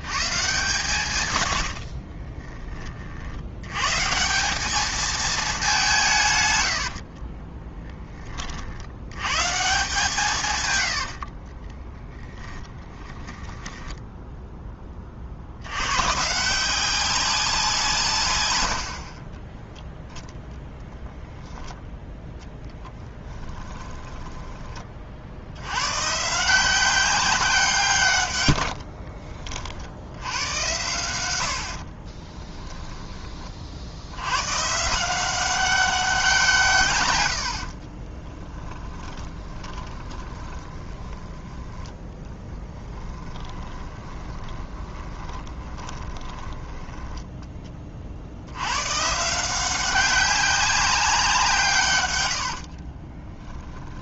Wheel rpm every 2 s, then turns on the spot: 140, 30, 210, 100, 70, 100, 20, 20, 180, 70, 0, 10, 30, 180, 60, 90, 10, 150, 150, 20, 20, 10, 20, 10, 110, 200, 60.
6-8 10-14 28-30 38-48 52-54